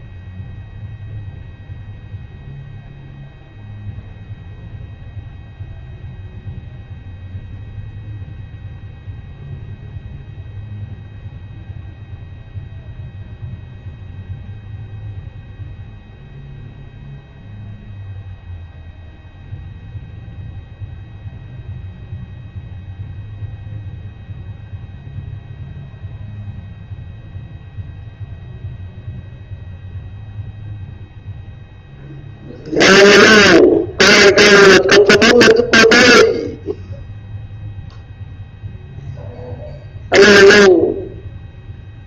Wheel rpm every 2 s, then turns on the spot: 0, 0, 0, 0, 0, 0, 0, 0, 0, 0, 0, 0, 0, 0, 0, 0, 0, 0, 0, 0, 0.
none